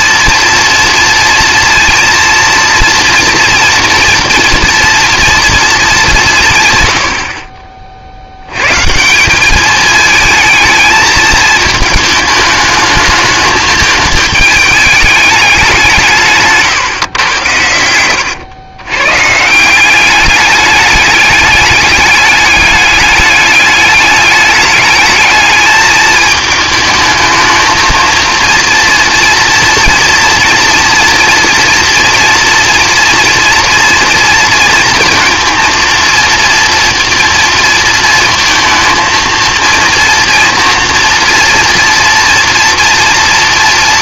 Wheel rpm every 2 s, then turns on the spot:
230, 230, 230, 140, 110, 220, 210, 210, 150, 100, 200, 200, 210, 220, 230, 240, 230, 230, 230, 220, 230, 230.
16-18